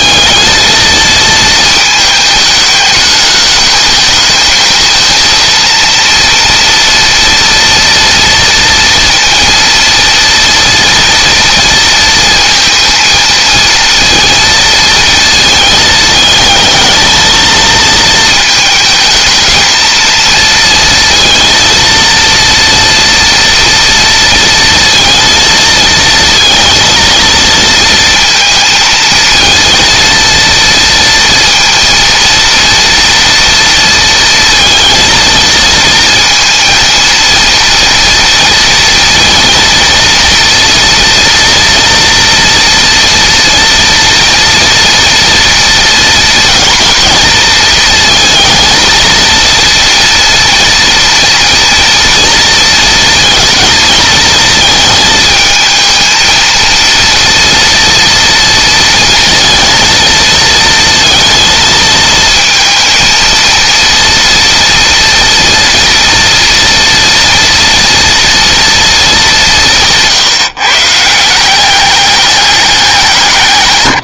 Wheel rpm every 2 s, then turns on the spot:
220, 210, 220, 230, 230, 230, 230, 230, 220, 220, 230, 230, 230, 230, 230, 230, 230, 230, 230, 230, 240, 230, 230, 230, 230, 230, 230, 220, 230, 230, 230, 230, 230, 230, 220, 150, 190.
none